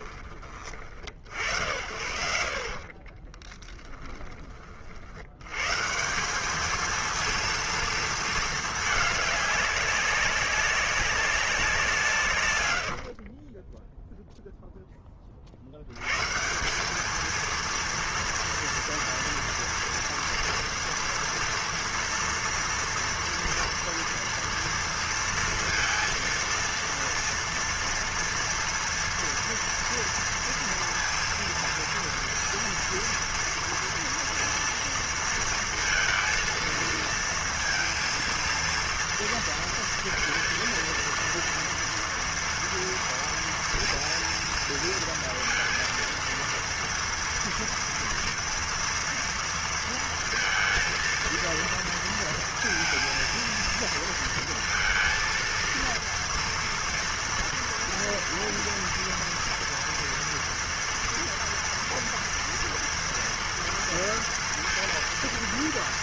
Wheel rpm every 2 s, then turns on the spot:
40, 50, 80, 230, 210, 190, 50, 60, 230, 230, 230, 230, 230, 230, 230, 230, 230, 230, 230, 230, 230, 230, 230, 230, 230, 230, 230, 230, 230, 230, 230, 230, 230.
2-4 12-14